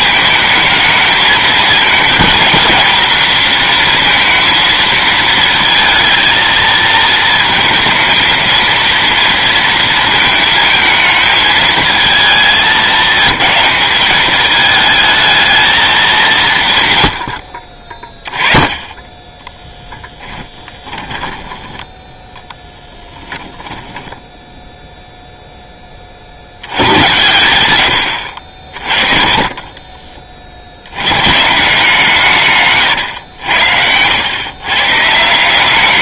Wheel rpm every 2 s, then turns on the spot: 230, 230, 220, 220, 230, 220, 210, 200, 30, 10, 10, 10, 0, 90, 50, 120, 110, 160.
18-20 22-24 28-30